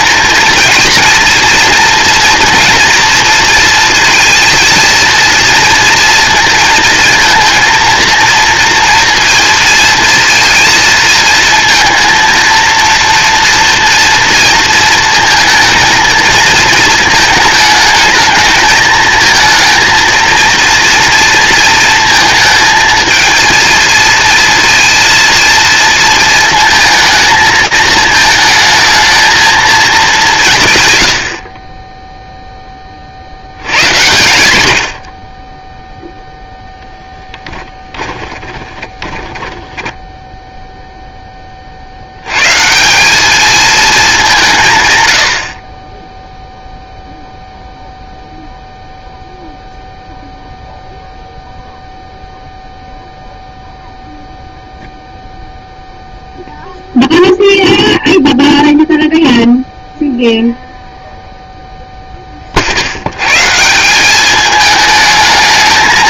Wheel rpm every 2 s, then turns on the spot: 230, 230, 230, 230, 230, 230, 230, 230, 220, 220, 230, 230, 230, 230, 220, 150, 20, 90, 0, 20, 0, 170, 120, 0, 0, 0, 0, 0, 0, 0, 0, 80, 210.
38-40